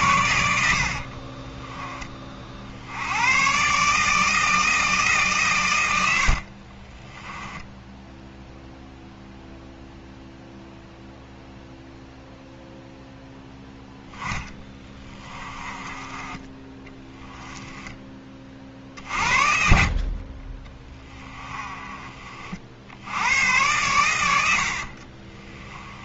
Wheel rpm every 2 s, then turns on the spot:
50, 90, 160, 40, 0, 0, 0, 20, 10, 50, 20, 80, 40.
0-2 6-8 14-18 20-22 24-26